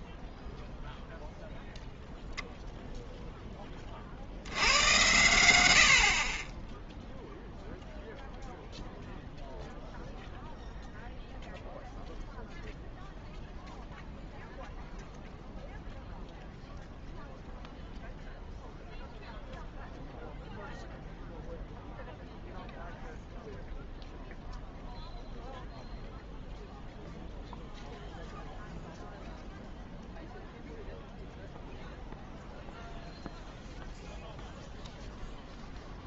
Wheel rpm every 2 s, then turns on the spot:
0, 0, 100, 10, 0, 0, 0, 0, 0, 0, 0, 0, 0, 0, 0, 0, 0, 0.
none